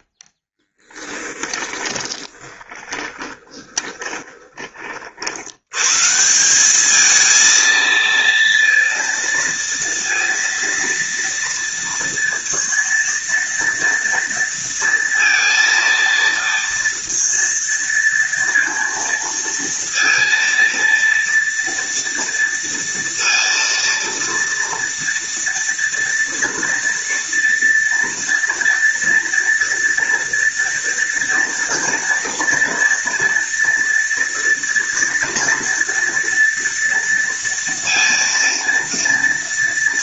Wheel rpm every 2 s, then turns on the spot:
20, 20, 50, 220, 230, 230, 230, 230, 230, 230, 230, 230, 230, 230, 230, 230, 230, 230, 230, 230.
0-4